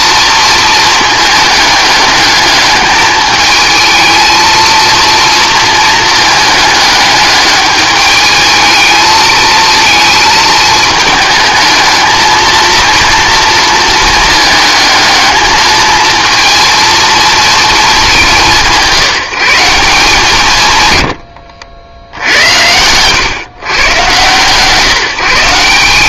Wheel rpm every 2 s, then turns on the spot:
230, 210, 230, 210, 220, 220, 230, 220, 230, 180, 130, 90, 140.
none